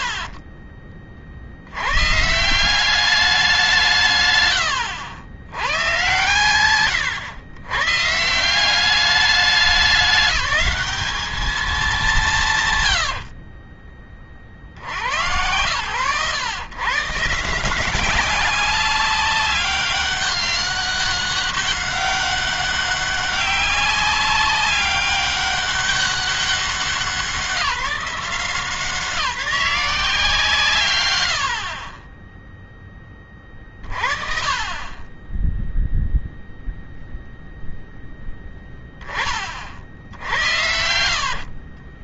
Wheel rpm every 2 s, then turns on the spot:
70, 150, 140, 140, 160, 200, 180, 40, 130, 190, 200, 200, 200, 190, 180, 160, 20, 40, 0, 0, 60.
4-6 40-42